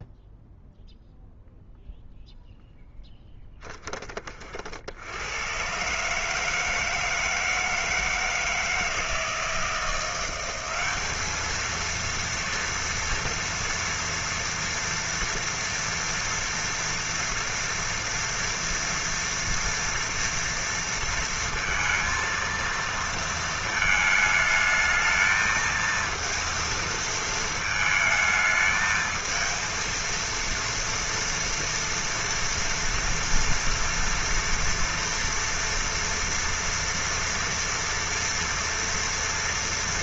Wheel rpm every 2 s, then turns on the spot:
0, 0, 40, 150, 160, 190, 230, 230, 230, 240, 230, 230, 210, 230, 220, 230, 230, 230, 230, 240.
none